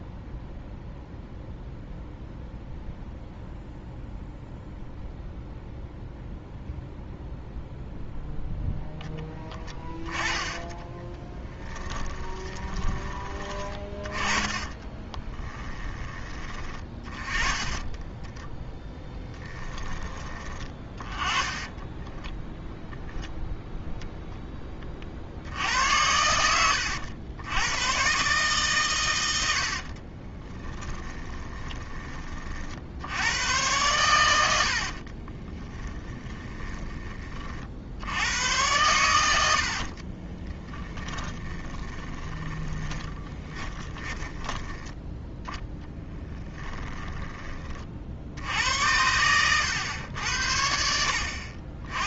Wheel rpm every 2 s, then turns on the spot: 0, 0, 0, 0, 10, 10, 20, 20, 30, 10, 20, 0, 30, 90, 130, 10, 70, 60, 20, 100, 10, 20, 10, 10, 90, 70.
10-12 14-16 30-32 34-36 40-44 46-48